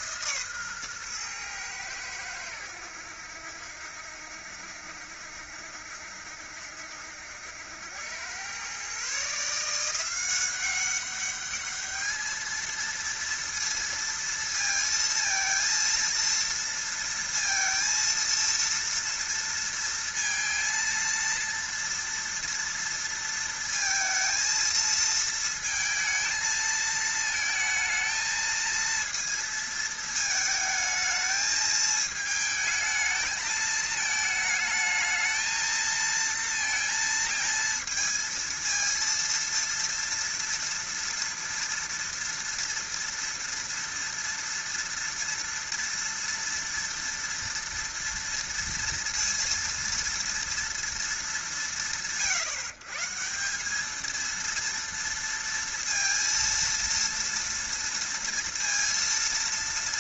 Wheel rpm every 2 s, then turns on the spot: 120, 80, 70, 70, 130, 200, 230, 230, 230, 230, 230, 230, 230, 220, 230, 220, 220, 220, 230, 230, 230, 230, 230, 230, 230, 180, 140, 230, 230, 230.
none